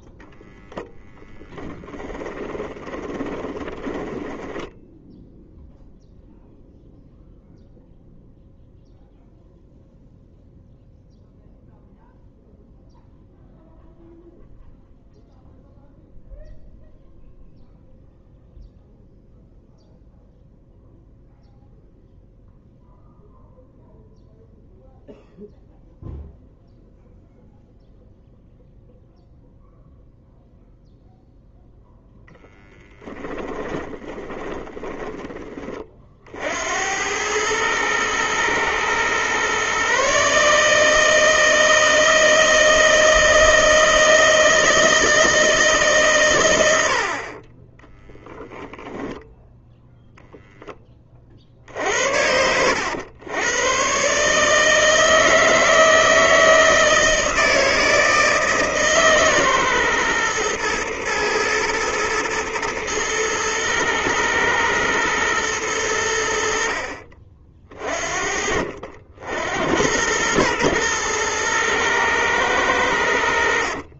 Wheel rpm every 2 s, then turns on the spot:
0, 10, 0, 0, 0, 0, 0, 0, 0, 0, 0, 0, 0, 0, 0, 0, 20, 20, 80, 120, 160, 160, 160, 70, 0, 20, 90, 160, 160, 150, 120, 110, 120, 50, 60, 110, 90.
2-4 32-36